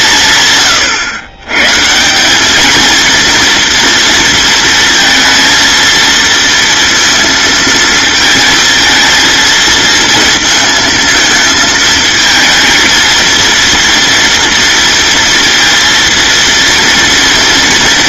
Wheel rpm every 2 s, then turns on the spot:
130, 230, 230, 230, 230, 220, 230, 230, 240.
none